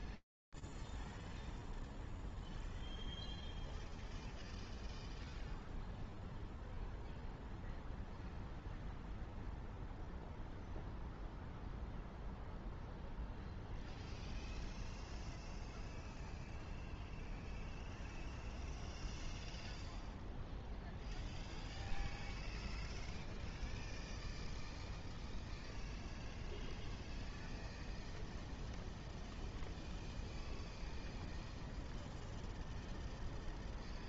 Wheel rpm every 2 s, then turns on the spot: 0, 0, 0, 0, 0, 0, 0, 0, 0, 0, 0, 0, 0, 0, 0, 0, 0.
none